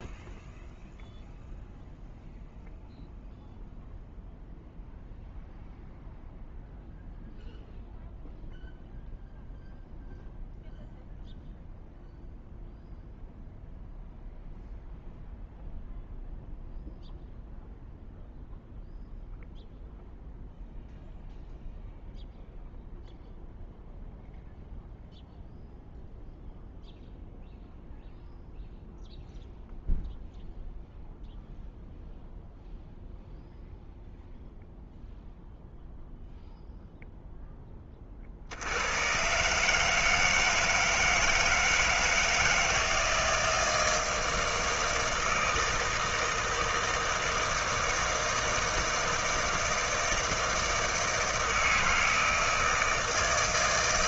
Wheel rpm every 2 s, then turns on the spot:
0, 0, 0, 0, 0, 0, 0, 0, 0, 0, 0, 0, 0, 0, 0, 0, 0, 0, 0, 60, 160, 160, 160, 160, 160, 160, 160.
none